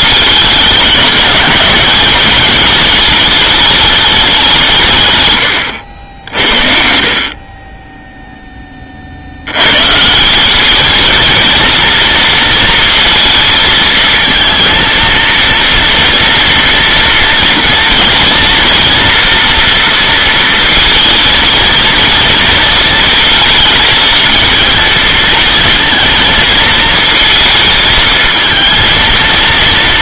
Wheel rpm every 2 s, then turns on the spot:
210, 220, 150, 60, 20, 210, 230, 230, 230, 230, 230, 220, 220, 230, 230.
none